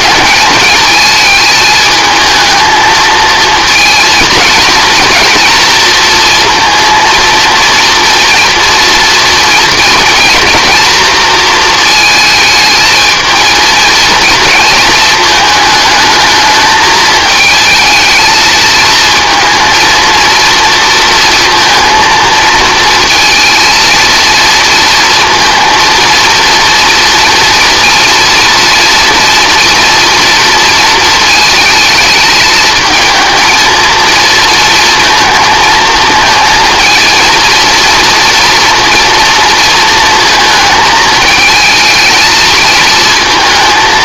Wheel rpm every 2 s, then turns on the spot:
220, 220, 230, 230, 230, 230, 220, 230, 220, 220, 230, 230, 230, 230, 240, 230, 220, 230, 230, 230, 220, 230.
none